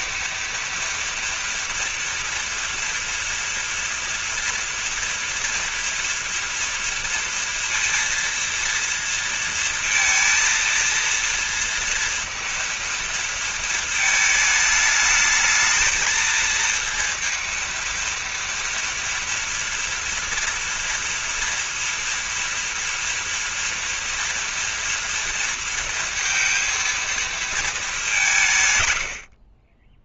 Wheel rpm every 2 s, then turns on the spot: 230, 230, 230, 240, 230, 230, 230, 220, 230, 230, 230, 230, 230, 230, 140.
none